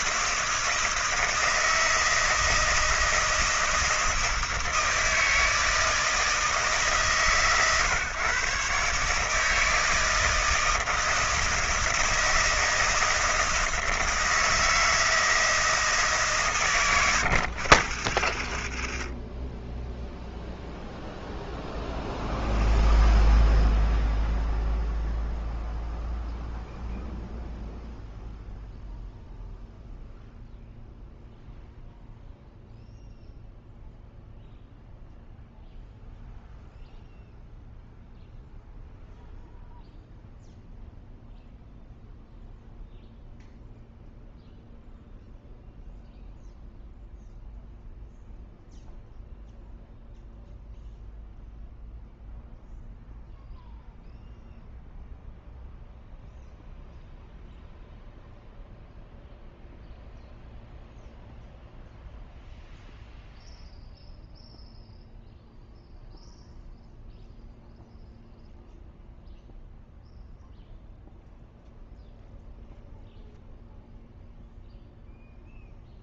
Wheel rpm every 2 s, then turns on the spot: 160, 160, 160, 150, 140, 160, 160, 160, 120, 50, 0, 0, 0, 0, 0, 0, 0, 0, 0, 0, 0, 0, 0, 0, 0, 0, 0, 0, 0, 0, 0, 0, 0, 0, 0, 0, 0, 0.
18-20